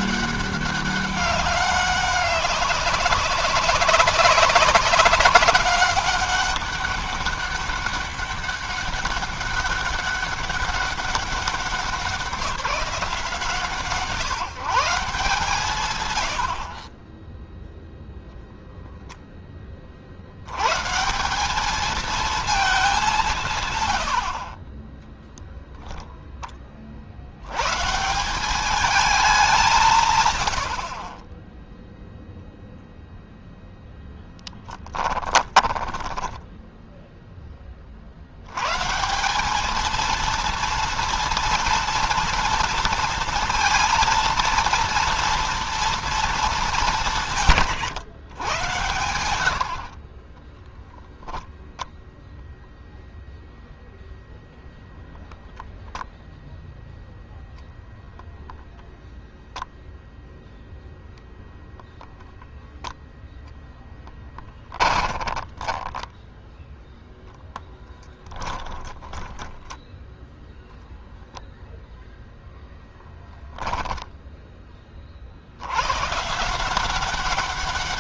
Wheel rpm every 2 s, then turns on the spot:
190, 190, 200, 200, 200, 200, 190, 170, 30, 0, 80, 230, 60, 0, 170, 130, 0, 0, 10, 90, 230, 230, 230, 220, 110, 20, 0, 0, 0, 0, 0, 0, 10, 10, 20, 10, 0, 10, 150.
36-38 50-52 64-66 68-70